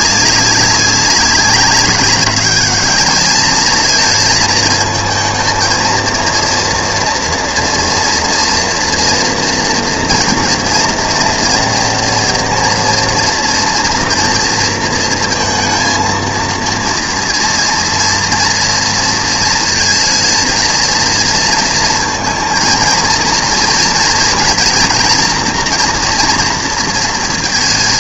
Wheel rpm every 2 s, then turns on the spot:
200, 210, 220, 230, 230, 230, 230, 230, 230, 230, 230, 230, 230, 230.
none